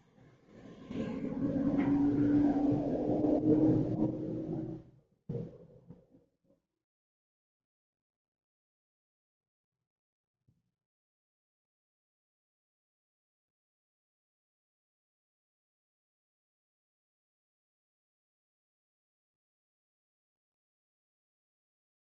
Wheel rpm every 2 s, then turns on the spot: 0, 0, 0, 0, 0, 0, 0, 0, 0, 0, 0.
none